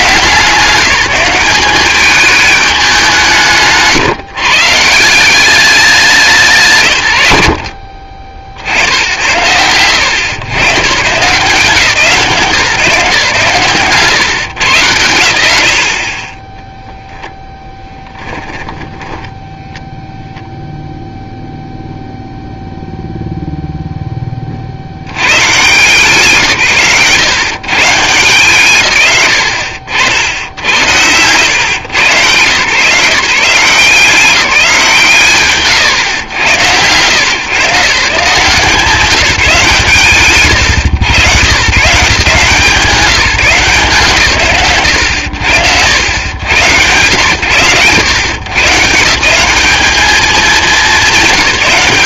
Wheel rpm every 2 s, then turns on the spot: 180, 180, 190, 130, 70, 150, 150, 90, 10, 10, 0, 0, 80, 110, 150, 100, 160, 150, 110, 170, 130, 170, 90, 110, 160, 170.
18-20